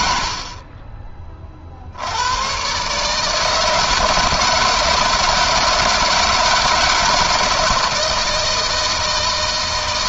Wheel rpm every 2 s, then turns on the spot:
40, 120, 160, 160, 160.
none